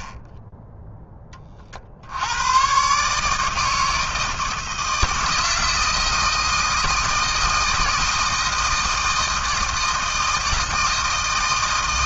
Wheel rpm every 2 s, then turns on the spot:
20, 110, 160, 160, 160, 160.
none